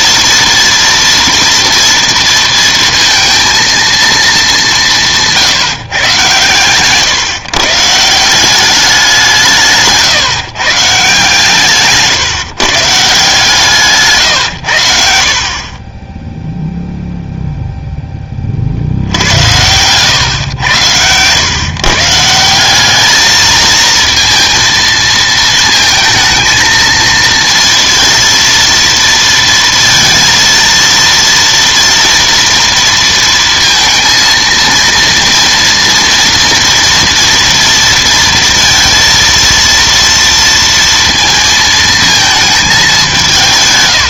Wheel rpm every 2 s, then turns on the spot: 230, 230, 200, 130, 190, 160, 140, 100, 0, 30, 110, 170, 230, 220, 230, 230, 230, 230, 230, 230, 230, 220.
none